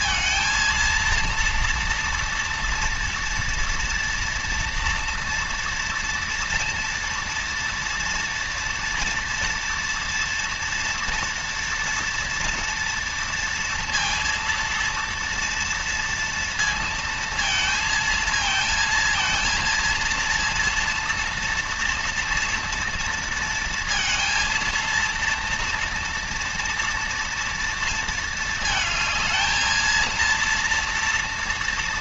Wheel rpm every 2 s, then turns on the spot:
230, 240, 230, 230, 230, 230, 230, 230, 230, 220, 230, 230, 230, 230, 220, 230.
none